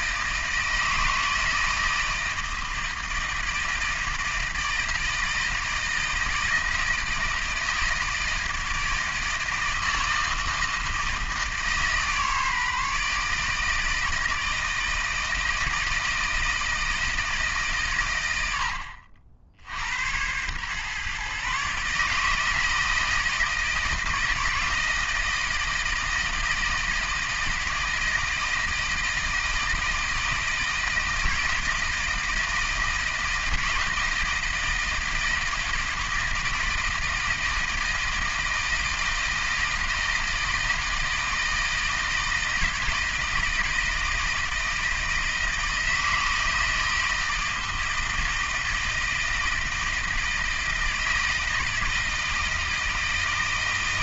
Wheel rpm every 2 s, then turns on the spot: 160, 160, 160, 160, 160, 160, 150, 160, 160, 70, 130, 160, 160, 160, 160, 160, 160, 160, 160, 160, 160, 160, 160, 160, 160, 160, 160.
none